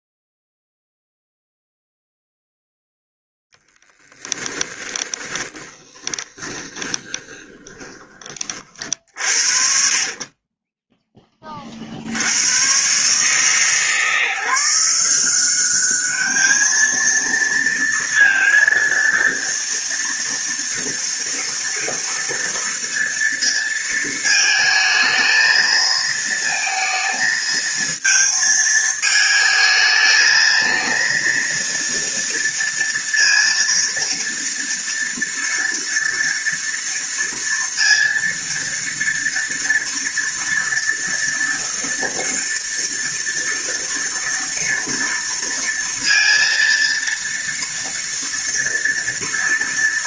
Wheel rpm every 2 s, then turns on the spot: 0, 0, 10, 20, 50, 10, 130, 180, 230, 230, 230, 230, 220, 230, 220, 230, 230, 230, 230, 230, 240, 230, 230, 230, 230.
4-8